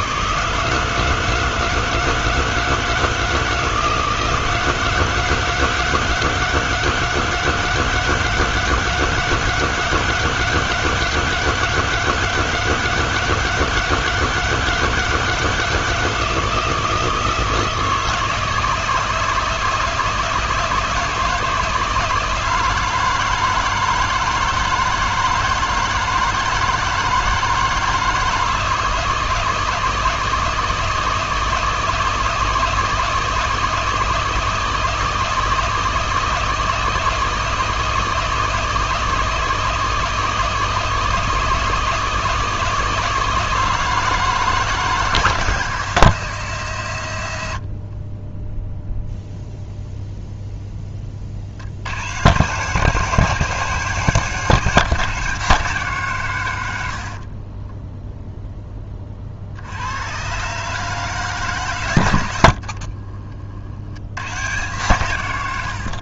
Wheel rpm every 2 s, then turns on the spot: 150, 160, 160, 160, 160, 160, 160, 160, 160, 160, 160, 160, 160, 160, 160, 160, 160, 160, 160, 160, 160, 160, 160, 120, 0, 10, 150, 160, 70, 20, 140, 40, 140.
62-64